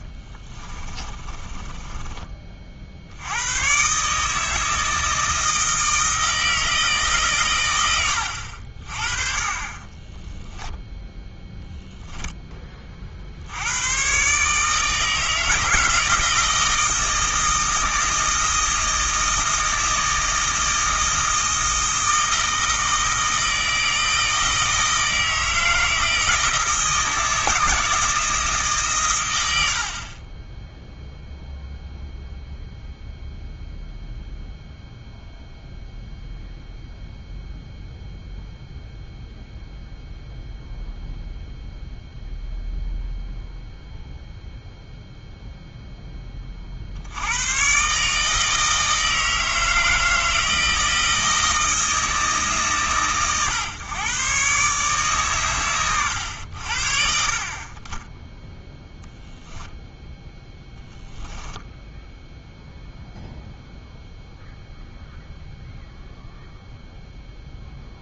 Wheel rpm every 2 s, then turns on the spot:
30, 60, 160, 150, 50, 10, 30, 160, 160, 160, 160, 160, 160, 160, 140, 0, 0, 0, 0, 0, 0, 0, 0, 60, 160, 160, 130, 130, 60, 0, 10, 0, 0, 0.
0-2 10-12 60-62